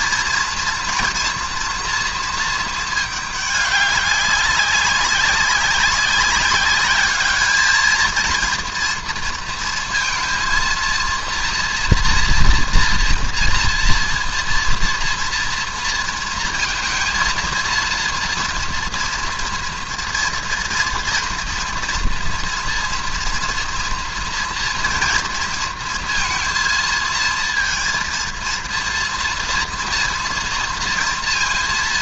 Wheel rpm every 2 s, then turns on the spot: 230, 220, 200, 200, 230, 230, 240, 230, 230, 230, 230, 230, 230, 230, 230, 230.
none